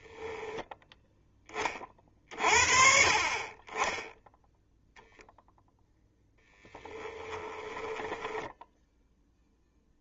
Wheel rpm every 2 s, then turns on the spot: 0, 50, 0, 10, 0.
6-8